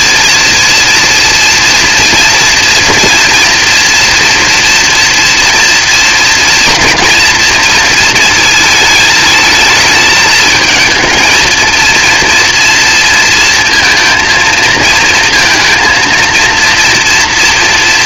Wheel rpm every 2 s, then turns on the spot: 230, 230, 230, 230, 220, 220, 230, 230, 240.
none